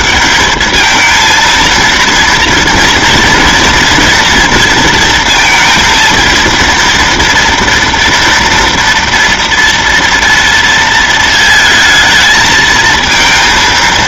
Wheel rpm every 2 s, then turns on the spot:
210, 230, 230, 230, 230, 230, 220.
none